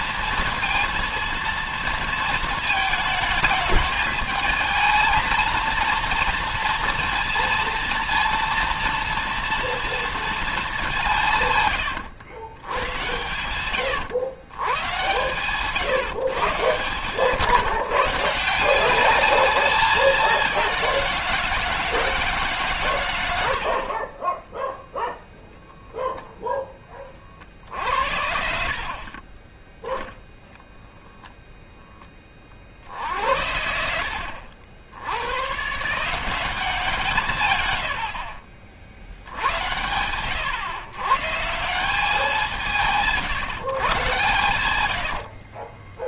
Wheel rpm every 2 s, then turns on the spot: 230, 220, 220, 230, 230, 220, 100, 120, 150, 180, 190, 140, 10, 10, 70, 0, 40, 80, 170, 50, 110, 170, 100.
24-26 44-46